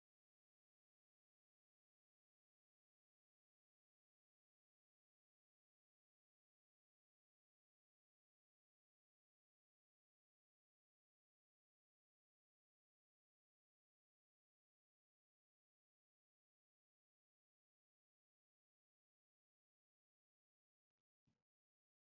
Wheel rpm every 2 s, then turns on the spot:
0, 0, 0, 0, 0, 0, 0, 0, 0, 0, 0.
none